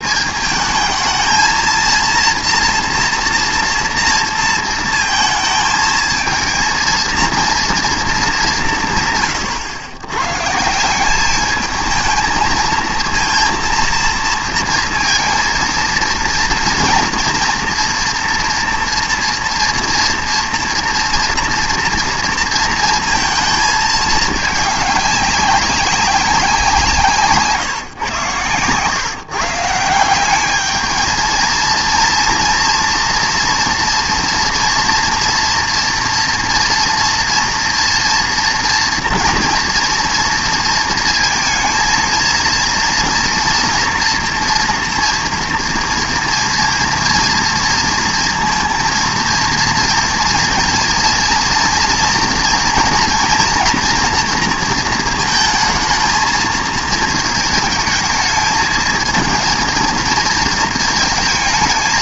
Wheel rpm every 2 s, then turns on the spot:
220, 240, 230, 230, 160, 180, 230, 230, 230, 230, 230, 230, 210, 170, 130, 210, 230, 230, 230, 240, 230, 230, 230, 230, 230, 230, 230, 230, 220, 220, 220.
none